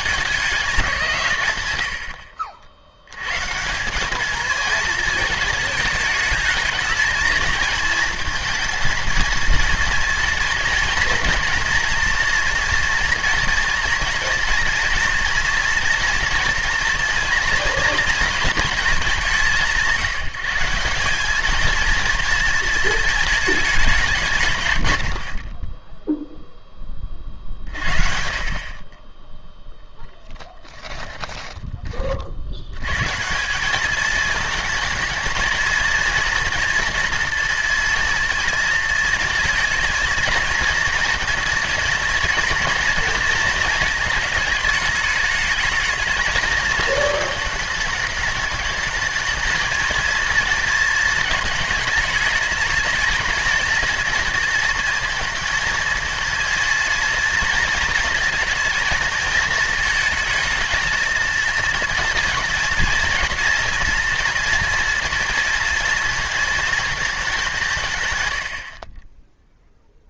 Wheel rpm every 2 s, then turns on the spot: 160, 70, 220, 220, 230, 240, 240, 230, 230, 210, 190, 230, 130, 20, 30, 20, 120, 230, 240, 230, 230, 230, 210, 220, 220, 230, 230, 230, 230, 230, 230, 230, 240, 220, 50.
30-32